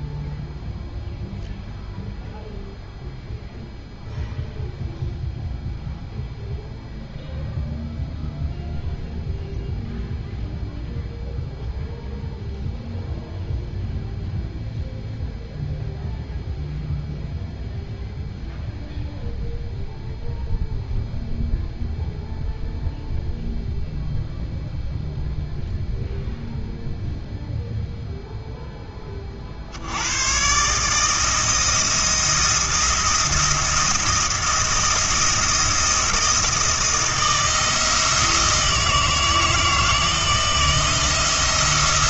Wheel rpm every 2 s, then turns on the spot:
0, 0, 0, 0, 0, 0, 0, 0, 0, 0, 0, 0, 0, 0, 0, 140, 170, 170, 160, 160, 170.
none